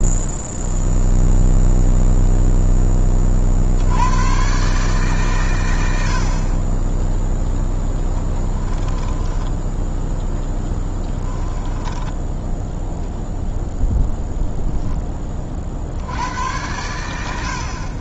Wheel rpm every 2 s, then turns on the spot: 0, 10, 140, 10, 20, 10, 0, 10, 90.
8-12